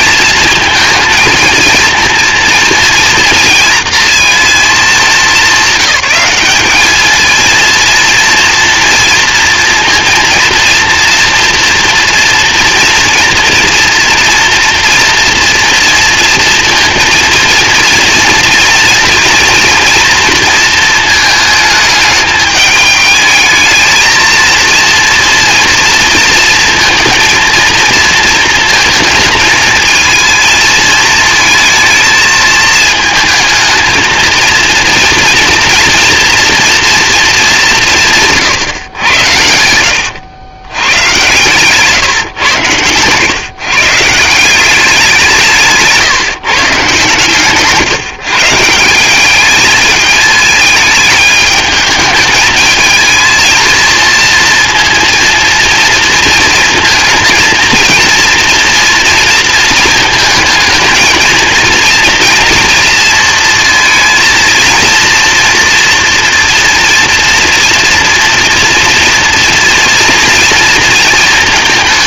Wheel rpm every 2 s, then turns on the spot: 230, 230, 220, 210, 230, 240, 230, 230, 230, 230, 230, 210, 230, 230, 220, 220, 220, 230, 230, 120, 100, 120, 190, 140, 160, 220, 220, 230, 230, 230, 220, 230, 230, 230, 230, 230.
42-44